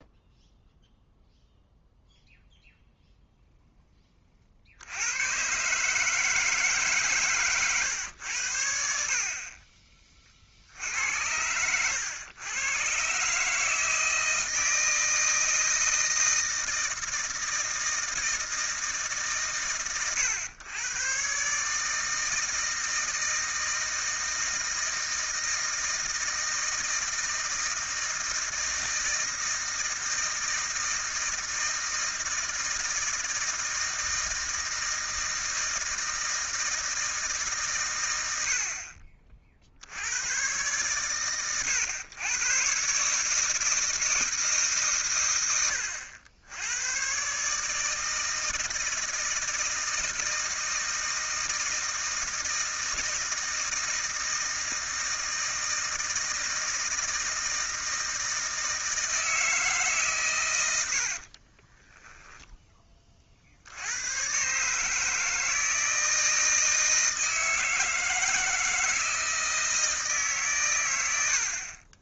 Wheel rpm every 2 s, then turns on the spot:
0, 0, 50, 150, 80, 60, 110, 160, 160, 160, 120, 160, 160, 160, 160, 160, 160, 160, 160, 70, 120, 120, 150, 100, 160, 160, 160, 160, 160, 160, 110, 10, 140, 160, 160, 110.
none